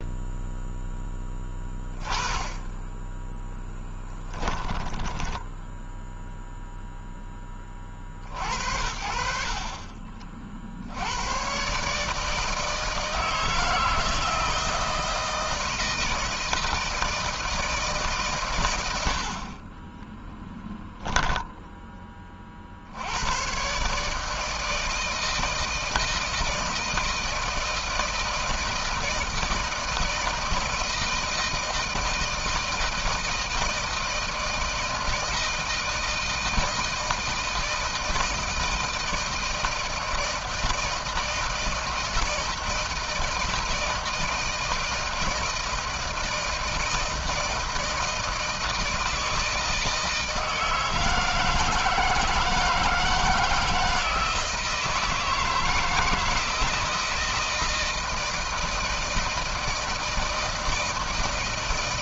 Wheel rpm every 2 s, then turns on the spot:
0, 10, 10, 0, 70, 50, 160, 160, 160, 120, 10, 40, 160, 160, 160, 160, 160, 160, 160, 160, 160, 160, 160, 160, 160, 160, 160, 160, 160, 160, 160.
4-6